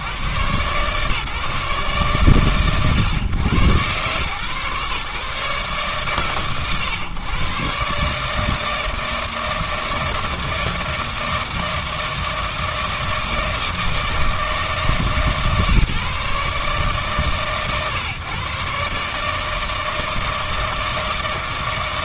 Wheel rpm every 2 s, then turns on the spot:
100, 120, 140, 110, 160, 160, 160, 160, 140, 140, 160.
none